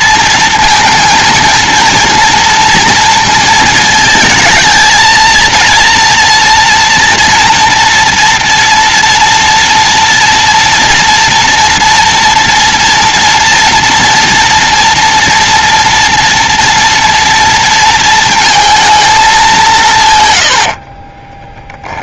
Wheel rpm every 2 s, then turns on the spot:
230, 230, 220, 230, 230, 230, 230, 230, 230, 230, 60.
20-22